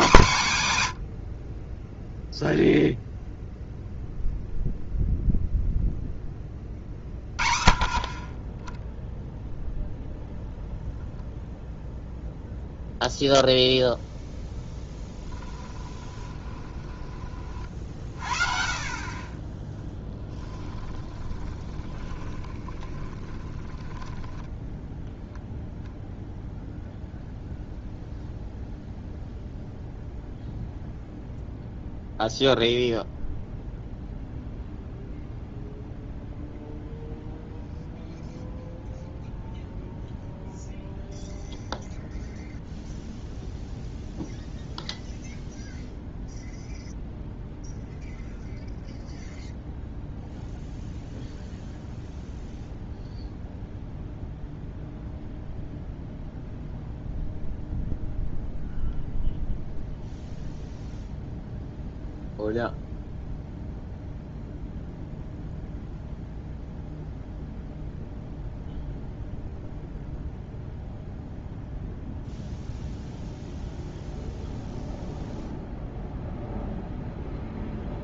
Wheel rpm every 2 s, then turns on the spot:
130, 0, 0, 30, 10, 0, 0, 10, 20, 40, 20, 30, 0, 0, 0, 0, 0, 0, 0, 0, 0, 0, 0, 0, 0, 0, 0, 0, 0, 0, 0, 0, 0, 0, 0, 0, 0, 0, 0.
14-18 20-24